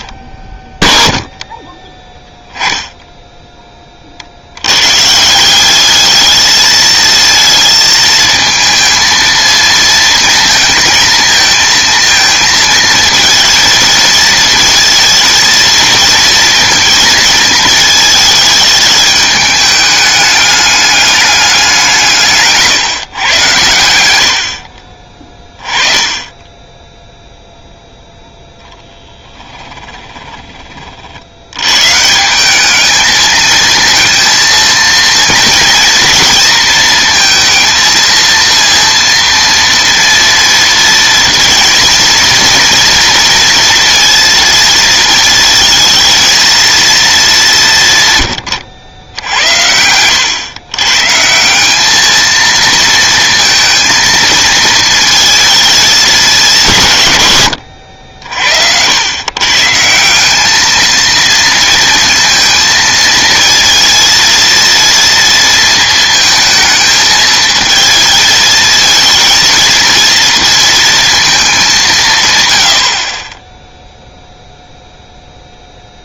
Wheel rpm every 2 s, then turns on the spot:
0, 0, 110, 220, 220, 230, 220, 230, 230, 210, 210, 140, 50, 10, 0, 30, 200, 230, 220, 230, 230, 230, 230, 230, 100, 110, 230, 220, 150, 80, 220, 230, 230, 220, 230, 230, 90, 0.
none